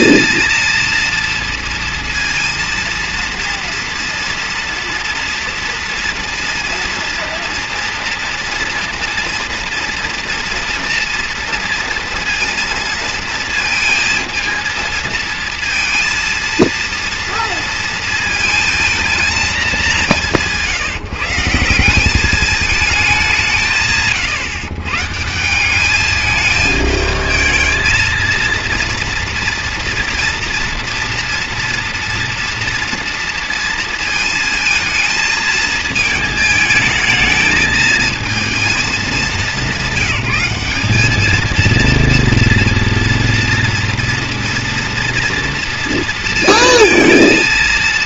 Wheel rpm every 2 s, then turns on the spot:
230, 230, 230, 230, 230, 230, 230, 230, 230, 230, 170, 210, 140, 220, 230, 230, 230, 220, 220, 230, 200, 230, 230, 230.
none